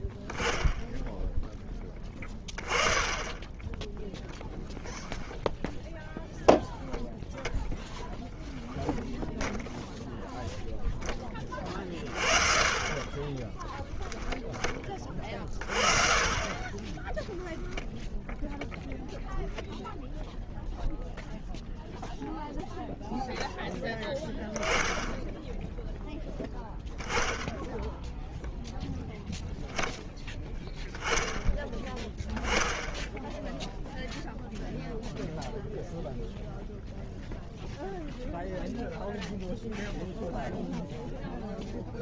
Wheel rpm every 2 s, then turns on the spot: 10, 20, 0, 0, 10, 0, 30, 10, 30, 0, 0, 0, 10, 0, 0, 0, 10, 0, 0, 0, 0.
none